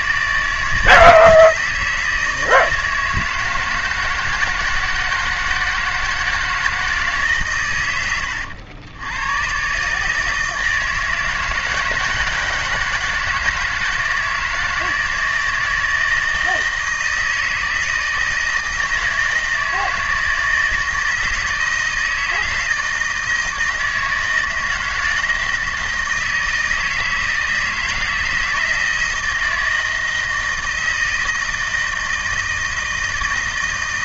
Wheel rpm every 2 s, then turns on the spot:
160, 160, 170, 160, 100, 160, 160, 160, 160, 160, 160, 160, 160, 160, 160, 160, 160.
none